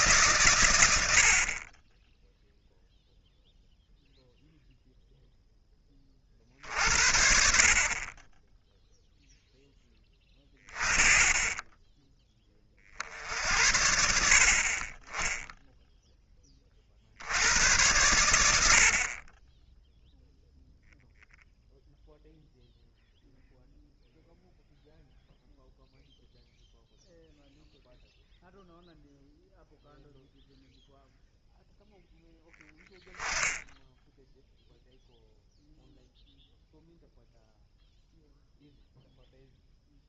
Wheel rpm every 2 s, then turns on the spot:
40, 0, 20, 40, 10, 0, 60, 0, 90, 0, 0, 0, 0, 0, 0, 0, 0, 0, 0, 0.
none